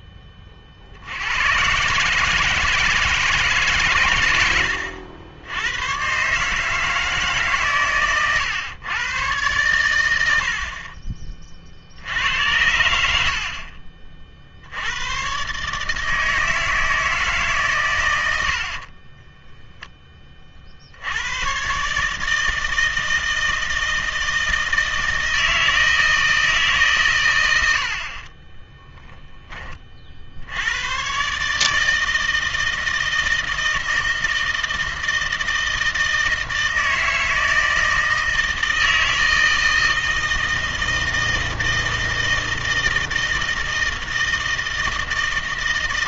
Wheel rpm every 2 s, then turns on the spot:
40, 160, 90, 150, 120, 50, 90, 80, 160, 50, 50, 160, 160, 140, 10, 100, 160, 160, 160, 160, 160, 160, 160.
18-20 28-30